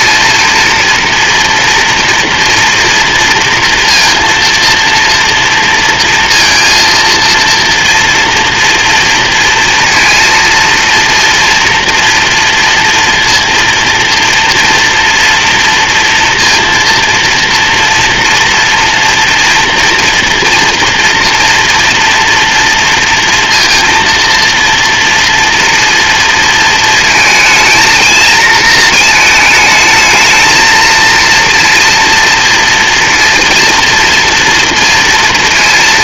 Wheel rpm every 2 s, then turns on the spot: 230, 230, 230, 230, 230, 230, 230, 230, 230, 230, 230, 230, 230, 230, 220, 230, 230, 230.
none